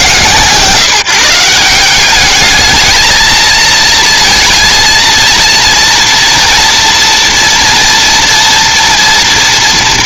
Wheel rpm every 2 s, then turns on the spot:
150, 220, 230, 230, 230.
none